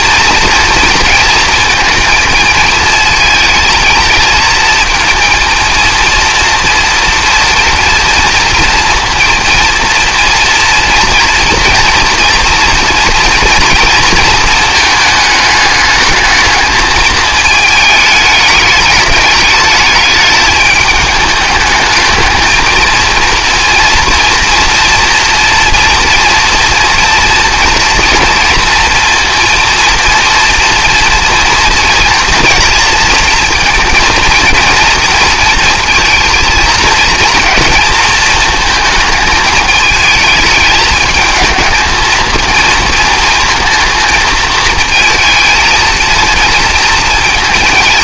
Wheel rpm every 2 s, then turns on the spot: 230, 220, 230, 230, 230, 230, 230, 220, 220, 210, 210, 220, 240, 230, 230, 230, 230, 230, 230, 220, 210, 230, 220, 230.
none